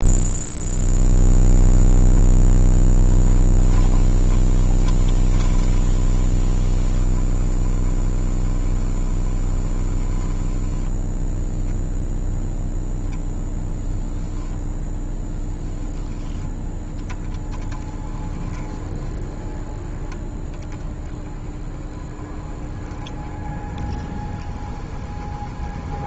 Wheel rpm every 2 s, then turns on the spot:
20, 30, 20, 20, 20, 10, 0, 0, 10, 20, 20, 20, 20.
none